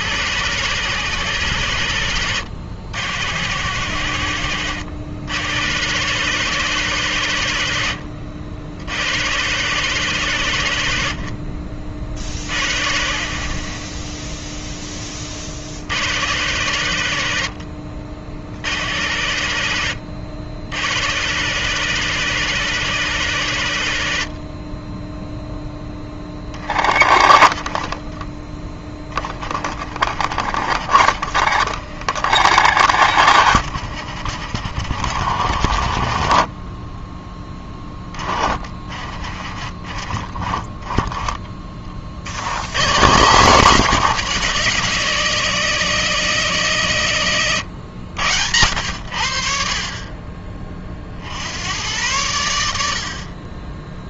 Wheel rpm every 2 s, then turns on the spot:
130, 90, 90, 130, 90, 90, 70, 20, 100, 80, 90, 140, 20, 40, 10, 50, 60, 60, 20, 40, 20, 110, 170, 130, 90, 40, 60.
26-42